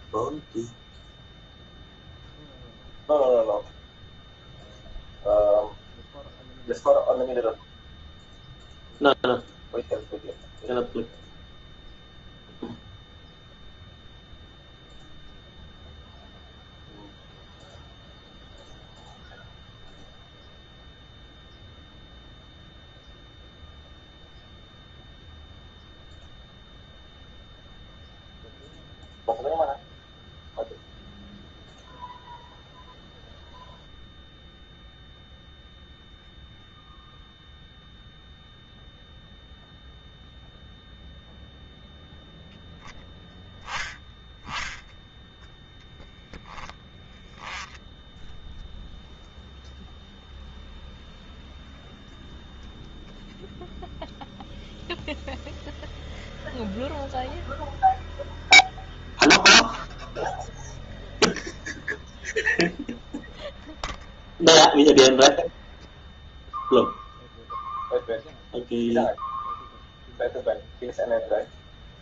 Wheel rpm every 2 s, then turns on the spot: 0, 0, 0, 0, 0, 0, 0, 0, 0, 0, 0, 0, 0, 0, 0, 0, 0, 0, 0, 0, 0, 0, 0, 10, 0, 0, 0, 0, 0, 0, 0, 0, 0, 0, 0, 0.
none